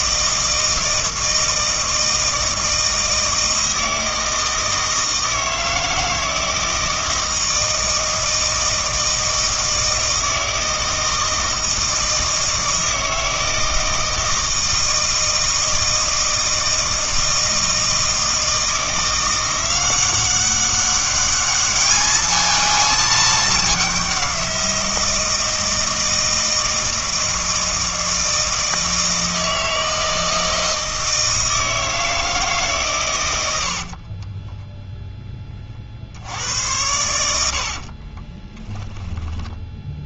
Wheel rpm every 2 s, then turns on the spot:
160, 160, 160, 160, 160, 160, 160, 160, 160, 160, 190, 220, 180, 160, 160, 160, 150, 10, 90, 10.
34-36 38-40